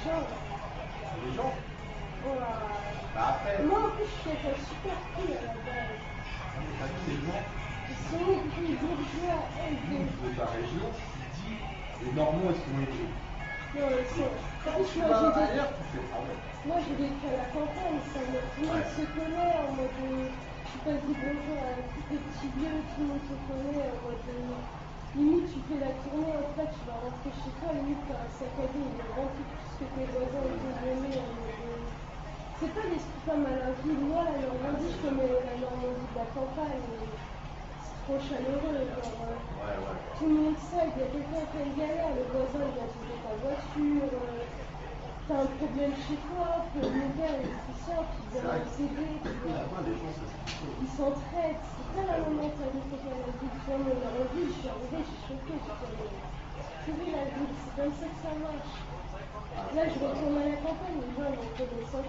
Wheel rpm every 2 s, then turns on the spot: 0, 0, 0, 0, 0, 0, 0, 0, 0, 0, 0, 0, 0, 0, 0, 0, 0, 0, 0, 0, 0, 0, 0, 0, 0, 0, 0, 0, 0, 0, 0.
none